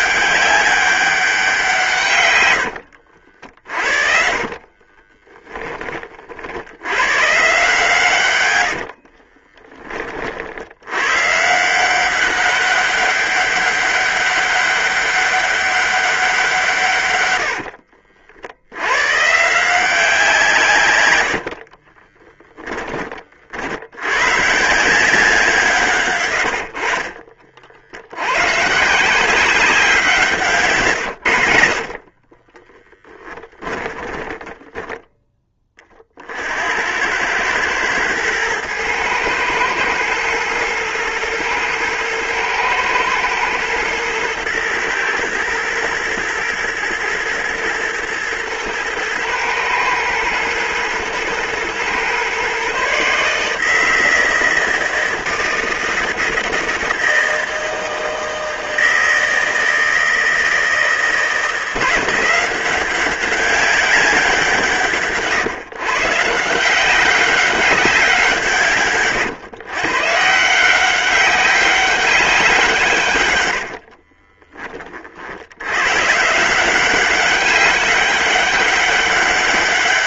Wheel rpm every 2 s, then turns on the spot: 200, 70, 20, 100, 60, 110, 200, 200, 140, 110, 120, 30, 170, 60, 150, 130, 10, 10, 100, 110, 110, 110, 120, 120, 110, 110, 140, 160, 160, 160, 160, 190, 150, 180, 140, 190, 140, 40, 190, 200.
2-6 8-10 20-22 26-28 30-34